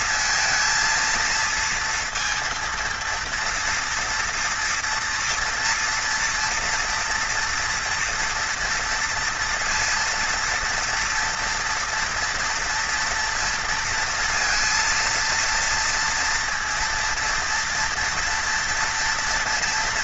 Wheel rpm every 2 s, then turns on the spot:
230, 230, 240, 240, 230, 230, 240, 230, 230, 230.
none